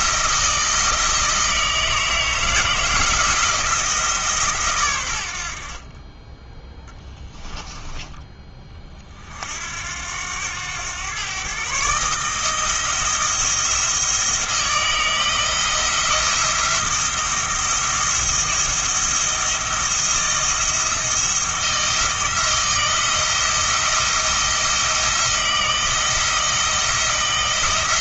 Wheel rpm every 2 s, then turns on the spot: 160, 160, 140, 10, 20, 100, 160, 170, 170, 170, 170, 170, 170, 160.
none